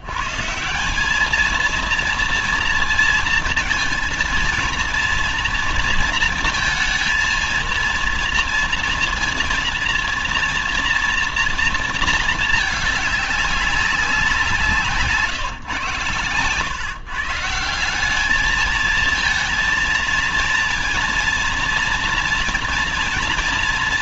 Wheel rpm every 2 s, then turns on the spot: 170, 230, 230, 230, 230, 230, 220, 170, 130, 220, 230, 240.
none